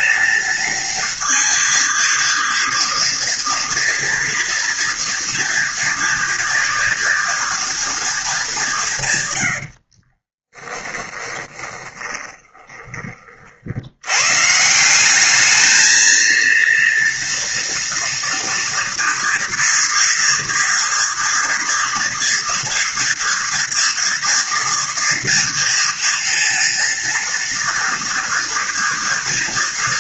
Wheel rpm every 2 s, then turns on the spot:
230, 230, 230, 230, 170, 10, 30, 160, 230, 230, 230, 230, 230, 230, 230.
10-12